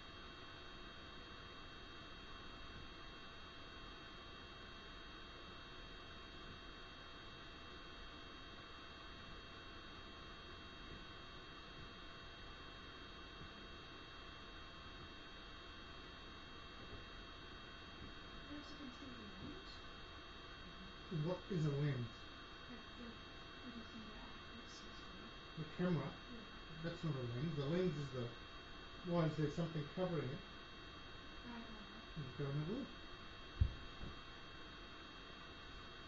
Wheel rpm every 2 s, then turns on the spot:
0, 0, 0, 0, 0, 0, 0, 0, 0, 0, 0, 0, 0, 0, 0, 0, 0, 0.
none